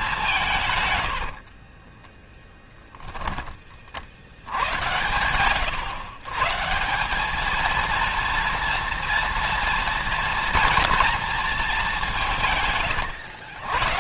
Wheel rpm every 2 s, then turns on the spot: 110, 0, 100, 170, 230, 230, 140.
0-2